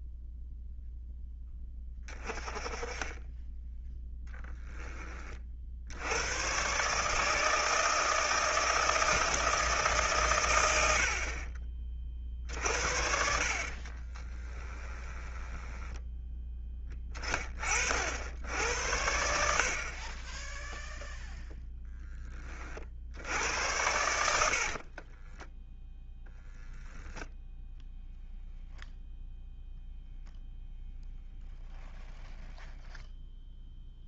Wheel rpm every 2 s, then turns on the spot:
0, 20, 10, 140, 160, 80, 50, 10, 20, 90, 0, 60, 50, 0, 0, 0, 0.
14-16 24-26